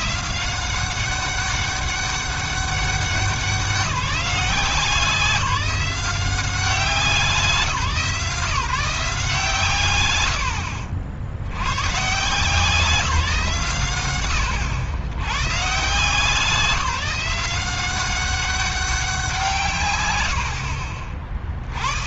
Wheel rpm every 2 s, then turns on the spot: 180, 200, 170, 180, 160, 70, 160, 100, 180, 200, 90.
10-12